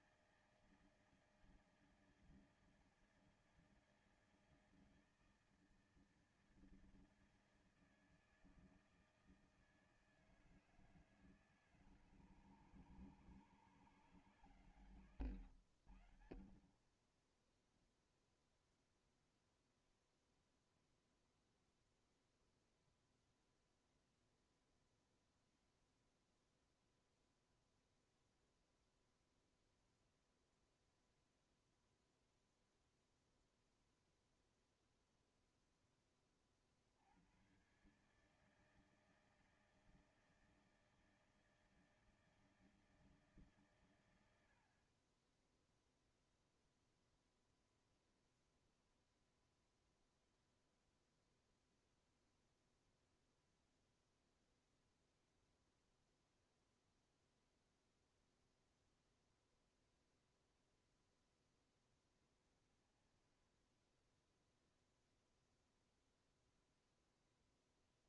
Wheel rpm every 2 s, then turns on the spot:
160, 160, 160, 160, 160, 160, 140, 150, 80, 0, 0, 0, 0, 0, 0, 0, 0, 0, 30, 150, 160, 160, 110, 0, 0, 0, 0, 0, 0, 0, 0, 10, 10, 0.
none